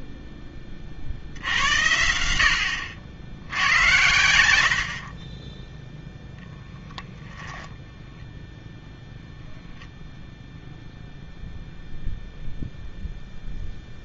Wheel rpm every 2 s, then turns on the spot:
20, 70, 70, 0, 0, 0, 0.
none